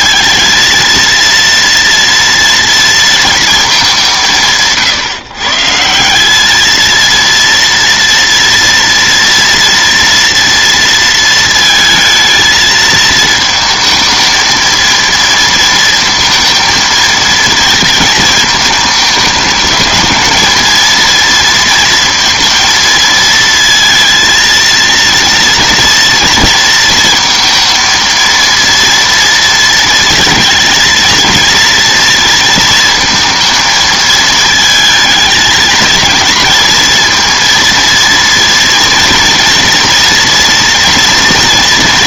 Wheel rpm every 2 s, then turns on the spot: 230, 230, 160, 220, 230, 230, 220, 220, 220, 220, 220, 230, 230, 230, 230, 220, 230, 220, 230, 230, 230.
none